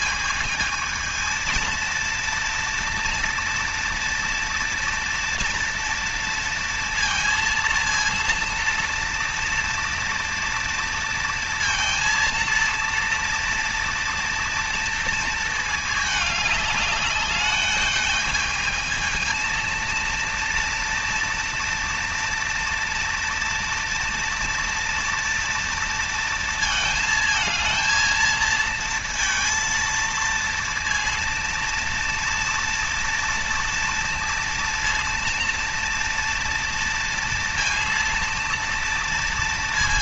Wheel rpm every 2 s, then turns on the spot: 220, 230, 230, 230, 230, 230, 230, 230, 210, 220, 230, 230, 230, 230, 230, 230, 230, 230, 230, 230.
none